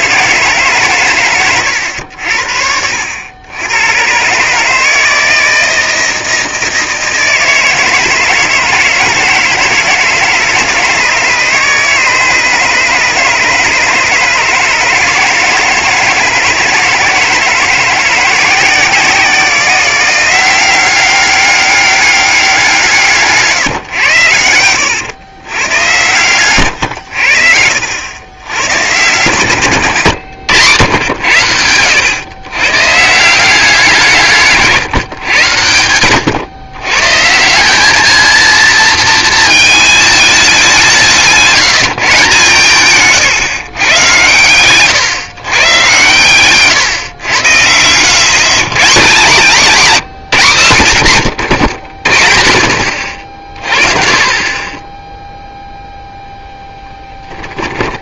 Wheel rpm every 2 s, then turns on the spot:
140, 70, 150, 160, 160, 160, 150, 150, 160, 170, 190, 180, 110, 120, 110, 110, 130, 150, 120, 230, 190, 150, 130, 130, 150, 100, 40, 20, 10.
56-58